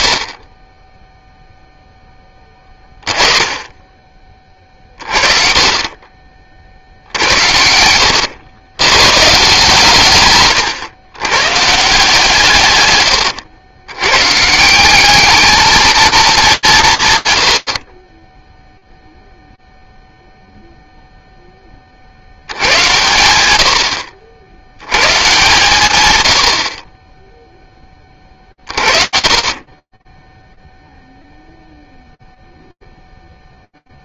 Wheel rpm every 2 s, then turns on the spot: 90, 10, 20, 60, 110, 130, 120, 180, 180, 0, 0, 110, 120, 20, 40, 0, 0.
none